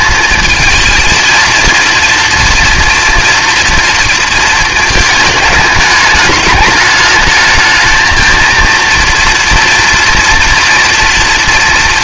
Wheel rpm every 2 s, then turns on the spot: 230, 230, 220, 210, 230, 230.
none